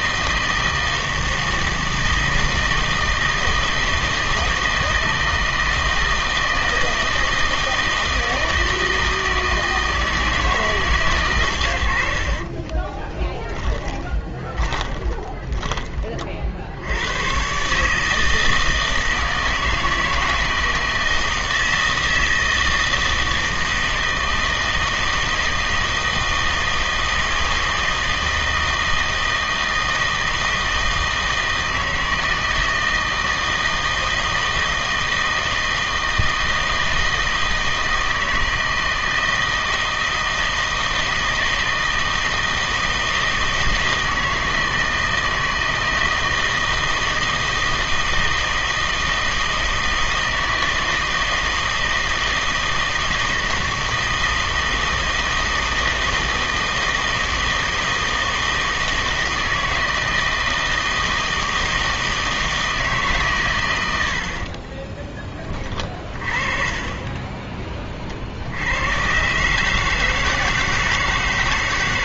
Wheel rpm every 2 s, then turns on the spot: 160, 160, 160, 160, 160, 150, 20, 20, 70, 160, 170, 160, 160, 160, 160, 160, 160, 160, 160, 160, 160, 160, 160, 160, 160, 160, 160, 160, 160, 160, 160, 160, 30, 20, 90, 160.
12-16 64-66